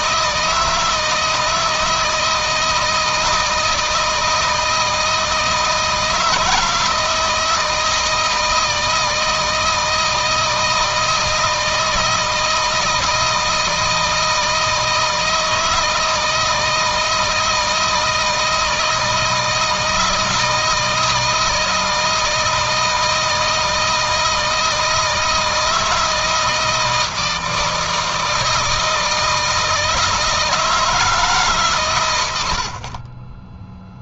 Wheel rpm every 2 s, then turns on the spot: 160, 160, 160, 160, 160, 160, 160, 160, 160, 160, 160, 160, 160, 160, 160, 160, 50.
none